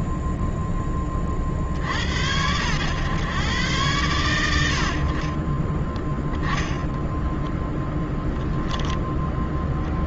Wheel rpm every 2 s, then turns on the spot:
10, 70, 100, 20, 0.
6-8